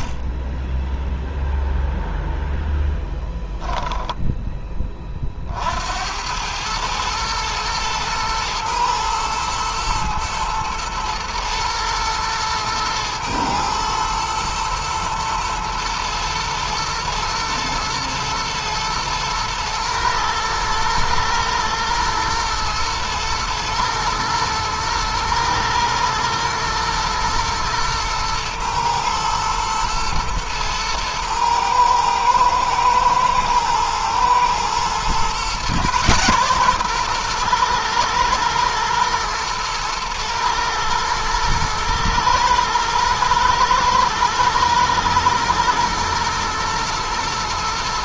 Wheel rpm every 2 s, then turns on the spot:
10, 0, 10, 100, 120, 110, 120, 120, 110, 120, 110, 120, 110, 120, 110, 120, 110, 120, 130, 120, 120, 120, 120, 110.
0-2